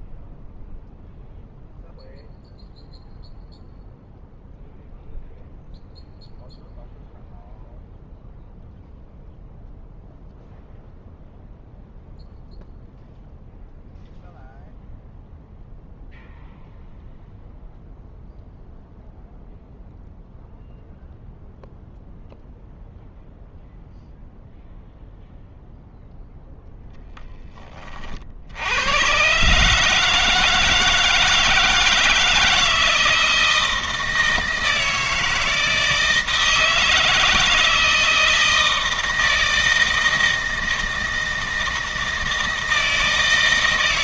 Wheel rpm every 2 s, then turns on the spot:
0, 0, 0, 0, 0, 0, 0, 0, 0, 0, 0, 0, 0, 0, 80, 160, 160, 160, 160, 160, 160, 160.
none